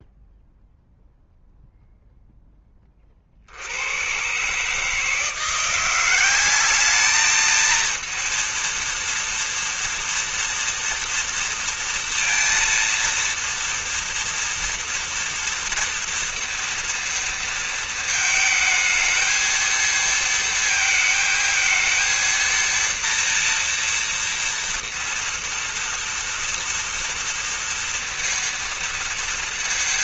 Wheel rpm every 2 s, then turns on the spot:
0, 0, 110, 180, 230, 230, 230, 230, 230, 220, 220, 230, 230, 230, 230.
none